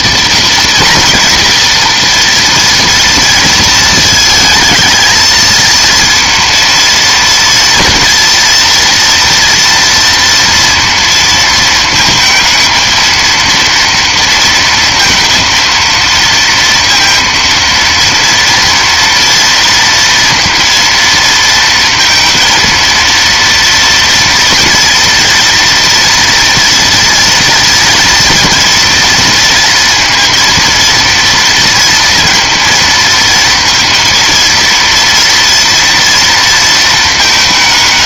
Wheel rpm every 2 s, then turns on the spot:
240, 230, 230, 230, 230, 230, 220, 230, 230, 230, 230, 230, 230, 230, 230, 230, 230, 230, 220.
none